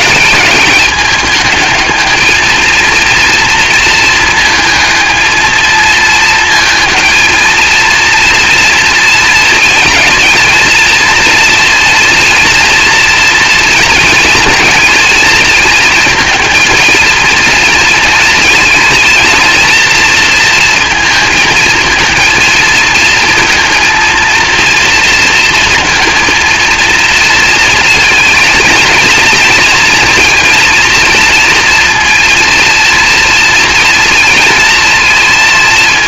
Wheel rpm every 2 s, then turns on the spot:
210, 220, 220, 230, 230, 230, 230, 230, 220, 220, 230, 220, 230, 230, 220, 230, 230, 230.
none